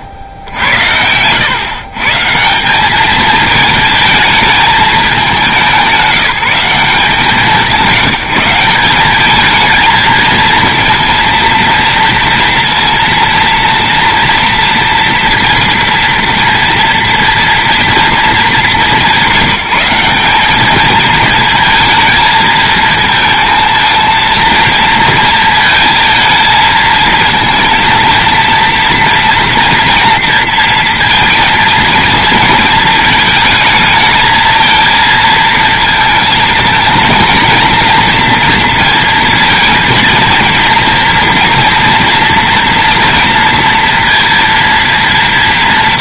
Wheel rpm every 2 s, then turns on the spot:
80, 180, 220, 180, 190, 230, 230, 230, 230, 210, 210, 230, 230, 220, 230, 230, 220, 220, 230, 230, 230, 230, 230.
0-2